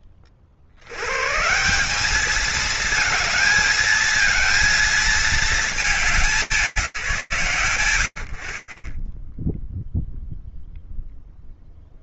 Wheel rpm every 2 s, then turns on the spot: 60, 220, 230, 170, 20, 0.
none